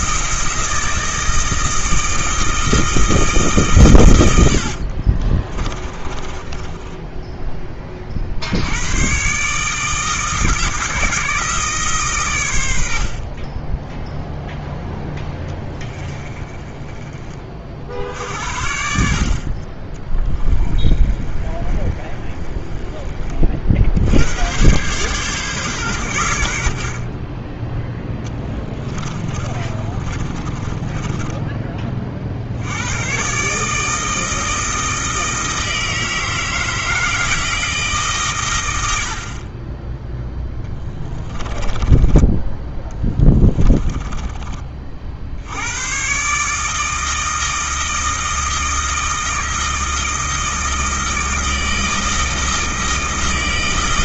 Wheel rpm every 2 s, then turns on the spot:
160, 160, 70, 20, 90, 160, 80, 10, 30, 60, 30, 20, 120, 60, 20, 20, 90, 160, 160, 100, 10, 10, 40, 150, 160, 160, 160.
4-8 16-18 20-24 28-32 40-42